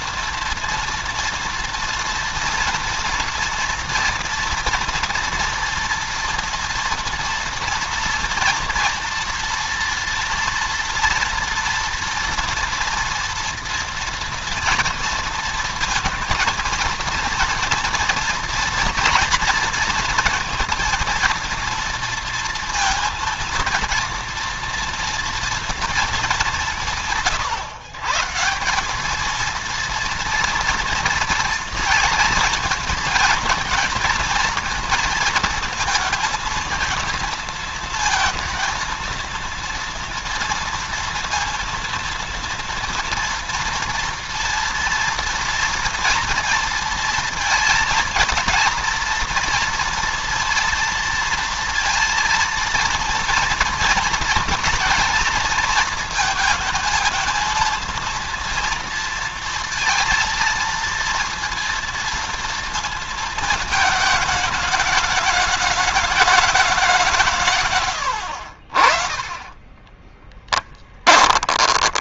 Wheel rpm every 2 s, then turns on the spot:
230, 230, 230, 230, 230, 230, 230, 230, 230, 230, 230, 230, 230, 170, 190, 230, 230, 230, 220, 230, 230, 230, 230, 230, 240, 230, 230, 230, 230, 230, 230, 230, 210, 190, 40, 10.
70-72